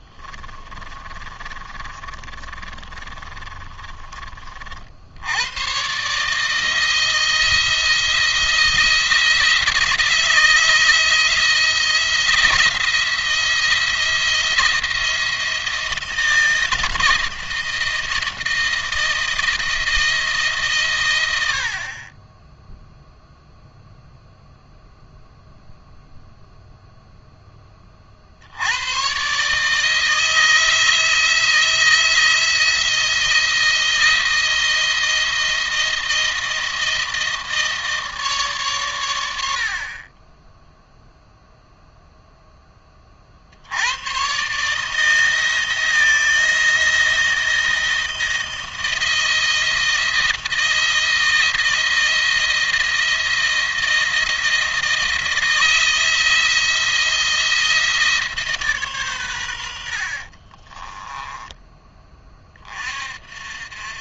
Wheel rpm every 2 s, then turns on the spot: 30, 30, 50, 160, 160, 160, 170, 170, 160, 170, 140, 0, 0, 0, 90, 160, 170, 170, 160, 130, 10, 10, 140, 170, 160, 160, 160, 160, 160, 140, 30, 30.
0-4 60-62